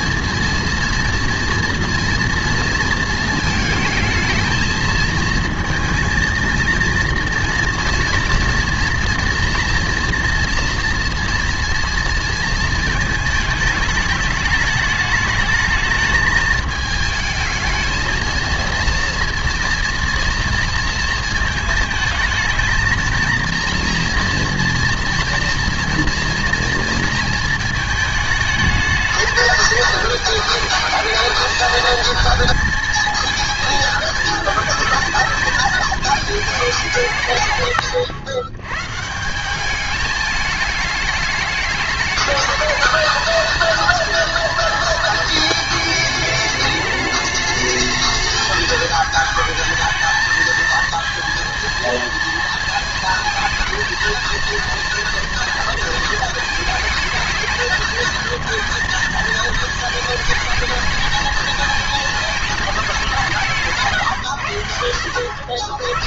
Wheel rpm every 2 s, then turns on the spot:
230, 230, 220, 230, 230, 230, 220, 210, 210, 230, 230, 220, 230, 230, 220, 220, 220, 220, 200, 120, 210, 220, 230, 210, 220, 220, 230, 230, 230, 230, 220, 210, 90.
none